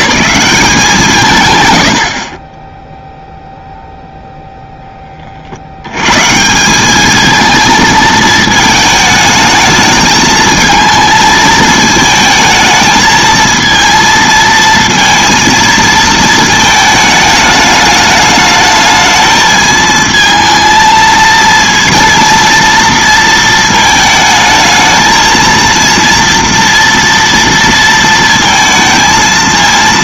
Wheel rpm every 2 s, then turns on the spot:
180, 10, 0, 170, 220, 220, 220, 230, 220, 220, 220, 230, 220, 230, 230.
none